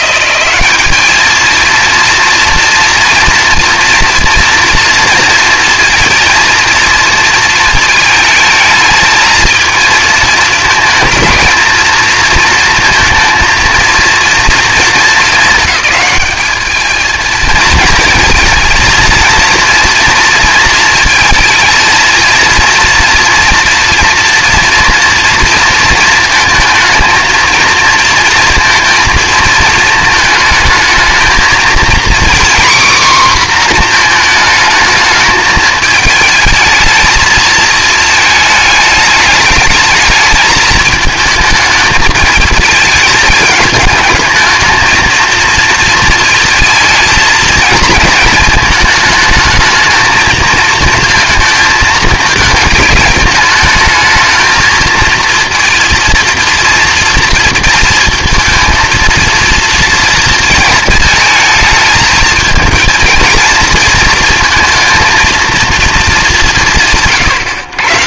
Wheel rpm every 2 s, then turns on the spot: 170, 230, 230, 220, 220, 220, 230, 230, 220, 220, 230, 220, 230, 230, 230, 220, 240, 240, 210, 220, 210, 220, 210, 230, 220, 220, 220, 210, 230, 230, 230, 220, 230, 230.
none